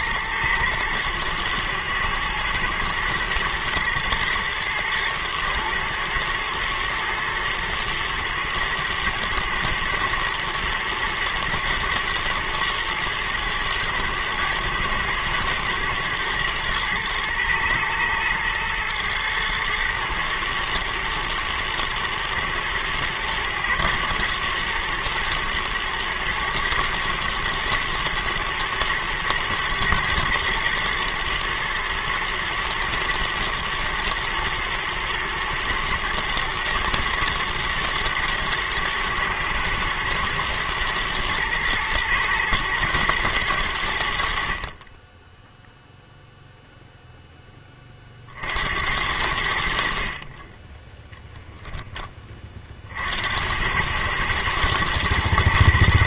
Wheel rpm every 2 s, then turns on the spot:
110, 120, 110, 110, 110, 110, 120, 120, 110, 110, 110, 110, 110, 110, 110, 120, 120, 110, 120, 120, 120, 120, 40, 0, 70, 20, 40, 110.
50-52